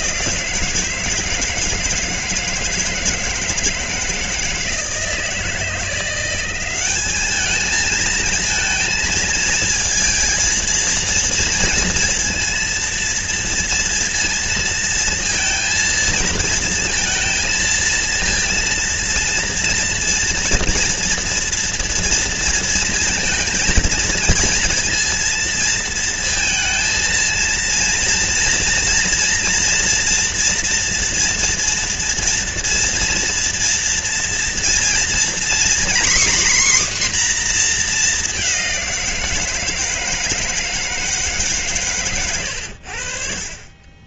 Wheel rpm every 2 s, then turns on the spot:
160, 160, 160, 200, 220, 230, 230, 230, 230, 230, 230, 230, 230, 230, 240, 230, 230, 240, 260, 180, 160, 70.
none